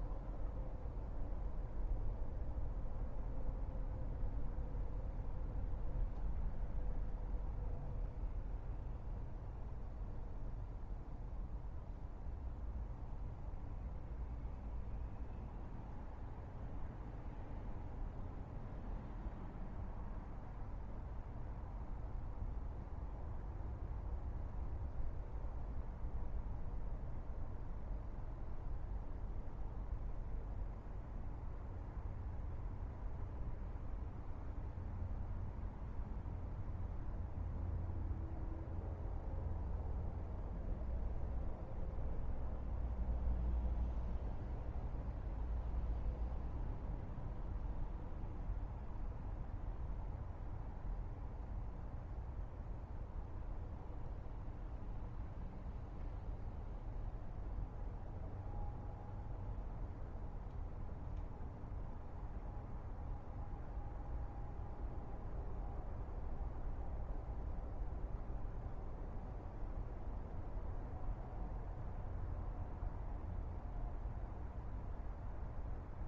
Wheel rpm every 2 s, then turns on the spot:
0, 0, 0, 0, 0, 0, 0, 0, 0, 0, 0, 0, 0, 0, 0, 0, 0, 0, 0, 0, 0, 0, 0, 0, 0, 0, 0, 0, 0, 0, 0, 0, 0, 0, 0, 0, 0, 0.
none